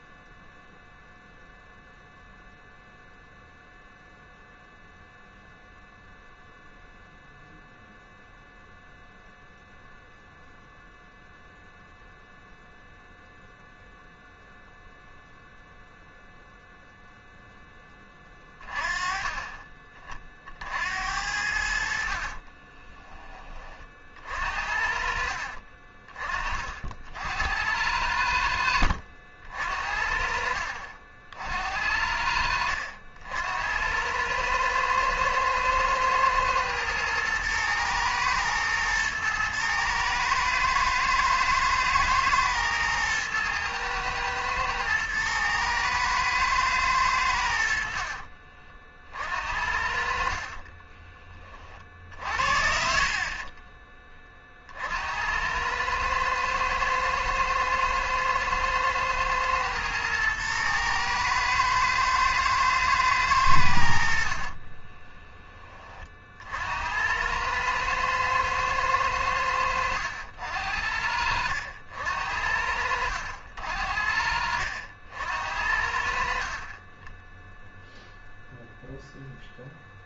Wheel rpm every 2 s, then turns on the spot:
0, 0, 0, 0, 0, 0, 0, 0, 0, 30, 60, 30, 50, 40, 70, 50, 80, 110, 110, 120, 110, 110, 110, 110, 40, 40, 50, 50, 110, 110, 110, 110, 30, 70, 110, 70, 70, 70, 40, 0.
22-24 50-52 64-66 76-78